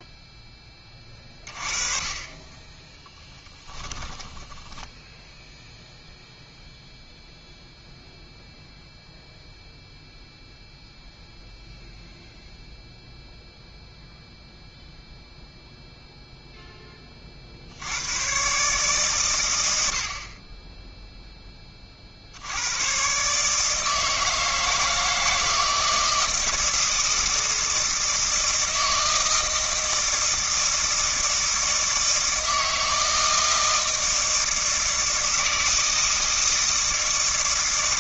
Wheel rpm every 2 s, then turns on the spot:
10, 20, 10, 0, 0, 0, 0, 0, 0, 140, 20, 90, 160, 170, 160, 160, 160, 160, 160.
4-6